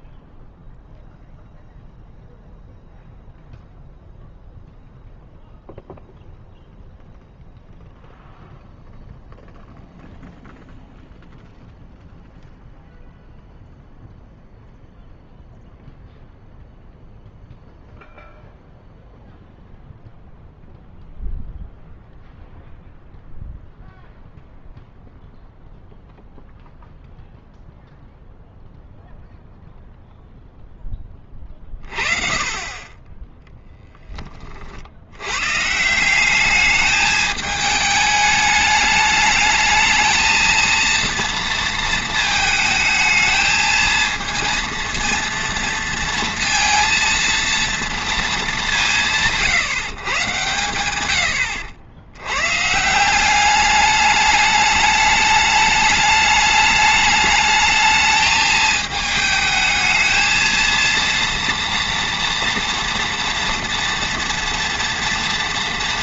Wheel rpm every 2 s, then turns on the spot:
0, 0, 0, 0, 0, 0, 0, 0, 0, 0, 0, 0, 0, 0, 0, 0, 30, 50, 210, 210, 230, 220, 230, 230, 190, 110, 140, 210, 210, 220, 230, 240, 230.
none